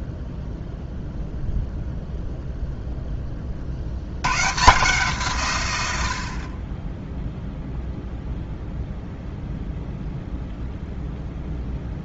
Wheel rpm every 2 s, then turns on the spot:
0, 0, 150, 20, 0, 0.
none